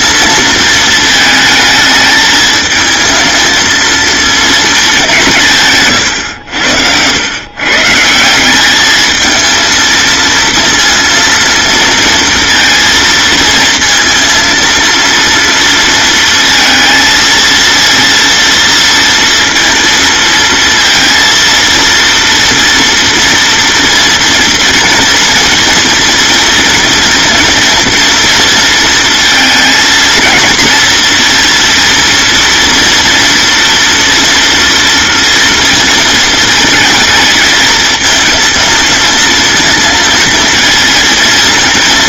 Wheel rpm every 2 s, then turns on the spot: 220, 220, 210, 90, 210, 230, 230, 230, 230, 230, 230, 230, 230, 230, 230, 230, 230, 230, 220, 230, 230.
none